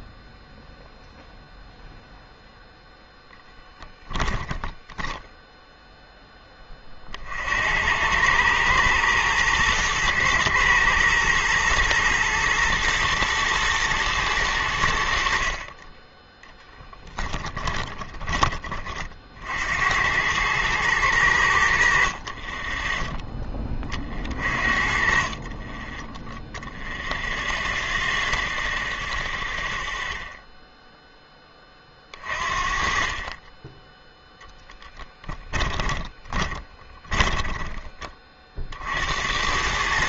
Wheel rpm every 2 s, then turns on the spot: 0, 0, 0, 20, 110, 110, 110, 100, 10, 30, 110, 20, 40, 0, 0, 0, 40, 0, 20, 50.
22-26 36-38